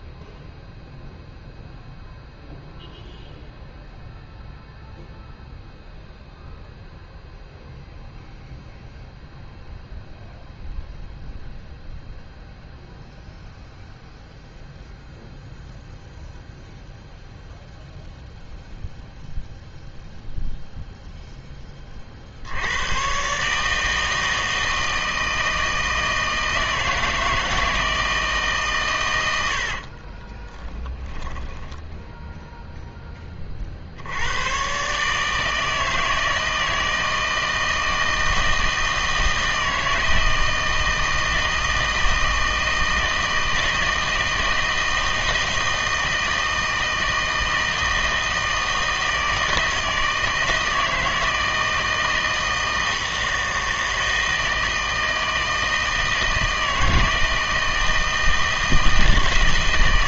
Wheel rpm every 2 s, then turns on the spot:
0, 0, 0, 0, 0, 0, 0, 0, 0, 0, 0, 100, 160, 160, 140, 10, 0, 120, 160, 160, 160, 160, 160, 160, 160, 160, 160, 160, 160, 160.
30-32